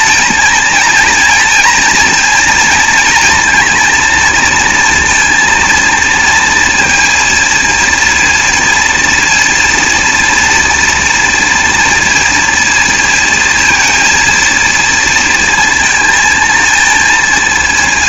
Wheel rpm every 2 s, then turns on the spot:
230, 230, 230, 230, 230, 240, 230, 230, 230.
none